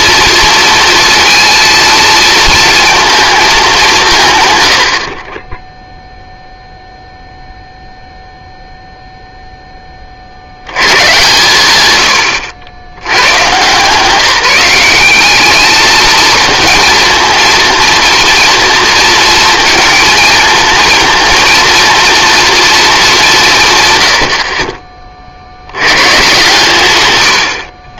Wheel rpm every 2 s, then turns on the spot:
230, 220, 90, 0, 0, 100, 90, 190, 230, 230, 220, 220, 40, 120.
none